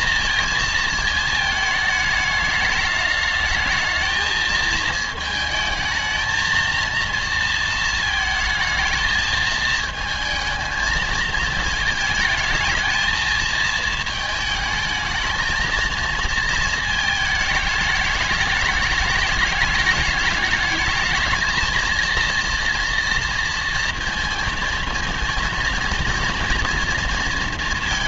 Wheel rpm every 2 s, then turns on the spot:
230, 210, 220, 220, 220, 220, 220, 220, 220, 210, 210, 230, 230, 230.
none